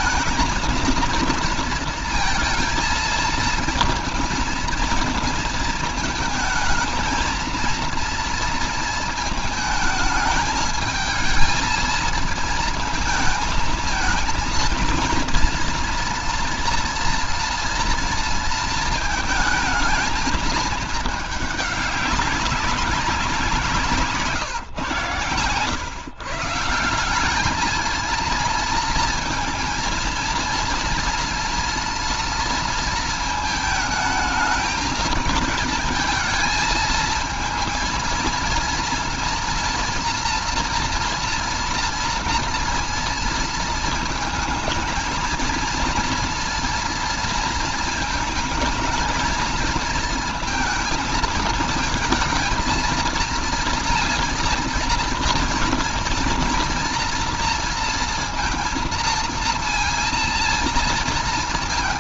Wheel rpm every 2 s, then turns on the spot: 230, 230, 230, 220, 230, 220, 220, 230, 230, 230, 220, 200, 140, 170, 230, 230, 230, 220, 220, 230, 240, 230, 230, 230, 220, 230, 230, 230, 240, 230, 230.
none